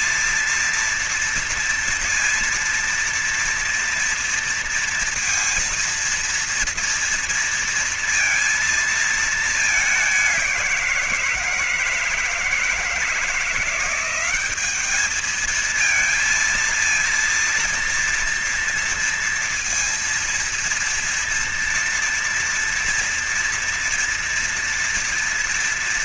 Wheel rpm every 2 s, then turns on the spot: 230, 230, 230, 230, 230, 200, 160, 180, 220, 230, 230, 230, 230.
none